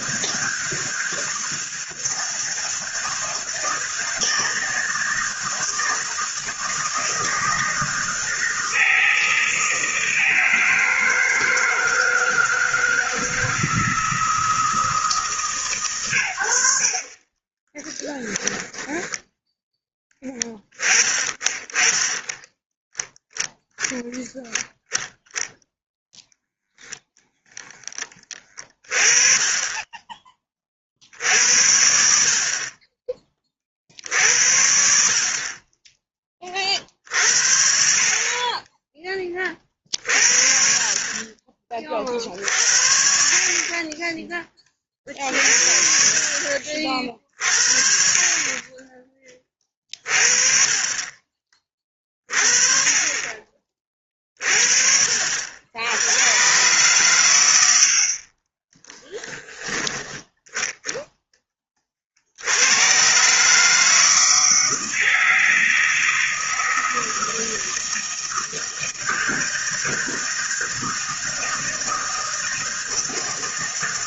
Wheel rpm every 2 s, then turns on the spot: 160, 160, 160, 160, 160, 160, 160, 160, 60, 10, 20, 10, 10, 0, 30, 30, 30, 70, 30, 30, 60, 60, 30, 50, 30, 30, 40, 40, 120, 20, 0, 80, 160, 160, 160, 160, 160.
18-20 58-60